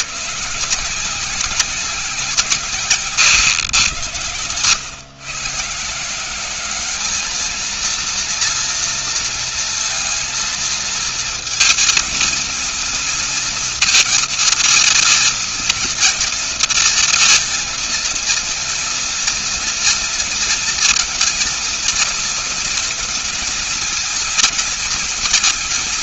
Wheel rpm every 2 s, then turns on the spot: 110, 170, 110, 170, 230, 230, 230, 230, 230, 230, 230, 230, 230.
none